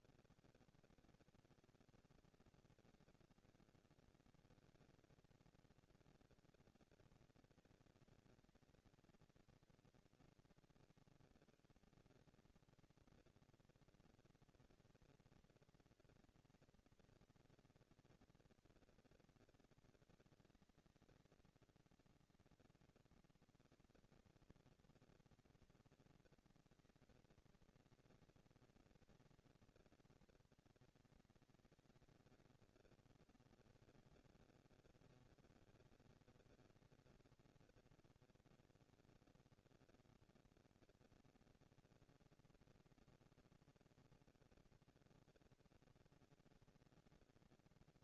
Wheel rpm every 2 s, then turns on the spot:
230, 200, 200, 220, 230, 170, 220, 230, 230, 230, 220, 230, 230, 230, 230, 230, 230, 220, 200, 210, 230, 240, 230, 230.
none